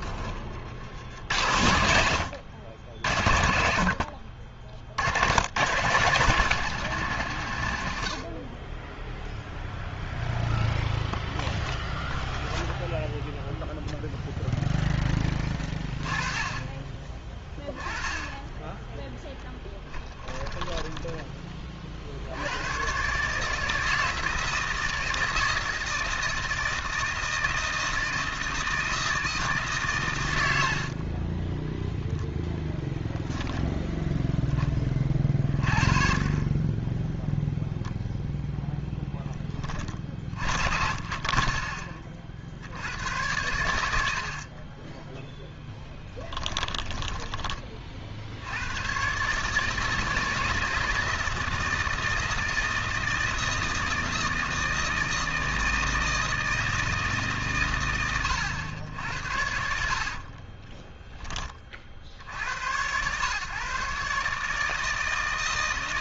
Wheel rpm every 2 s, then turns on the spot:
80, 80, 100, 150, 10, 0, 0, 10, 20, 10, 20, 130, 160, 160, 160, 40, 0, 30, 0, 10, 30, 100, 10, 10, 130, 160, 160, 160, 150, 80, 10, 120, 160.
20-22 30-32